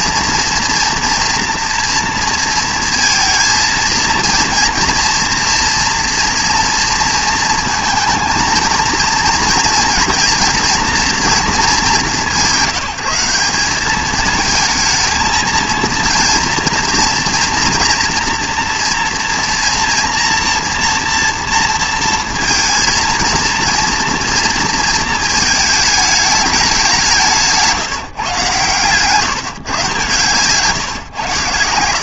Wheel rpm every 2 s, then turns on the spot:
230, 230, 230, 230, 230, 230, 170, 220, 230, 230, 230, 230, 230, 200, 140, 140.
none